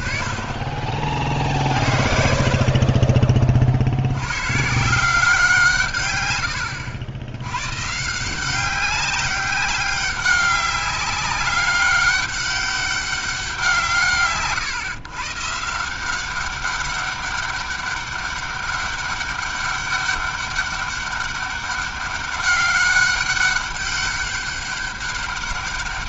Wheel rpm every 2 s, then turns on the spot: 50, 40, 130, 90, 180, 190, 200, 140, 190, 200, 200, 200, 200.
none